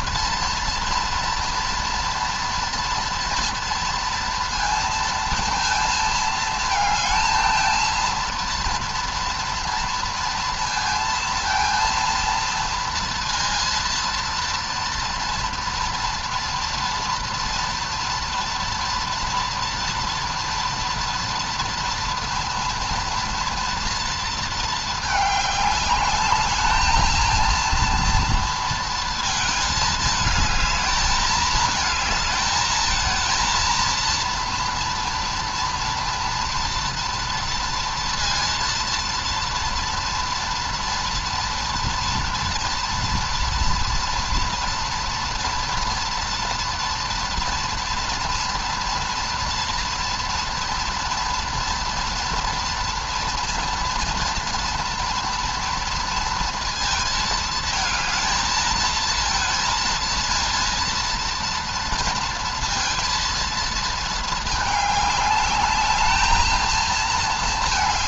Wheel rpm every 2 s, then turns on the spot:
230, 230, 230, 220, 230, 230, 230, 230, 230, 240, 230, 230, 230, 210, 230, 220, 220, 230, 230, 240, 240, 230, 230, 230, 230, 230, 230, 230, 230, 220, 230, 230, 220, 220.
none